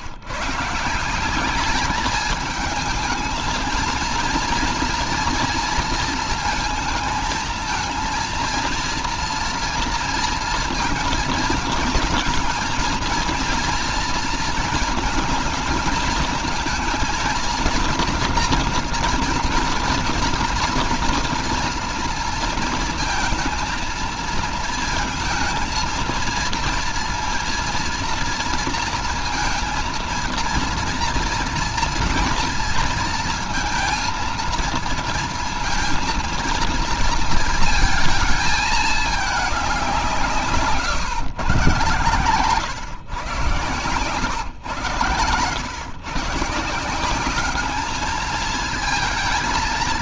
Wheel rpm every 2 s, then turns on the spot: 170, 210, 230, 220, 230, 230, 230, 220, 220, 240, 240, 230, 230, 230, 230, 230, 230, 230, 230, 220, 140, 120, 110, 160, 220.
none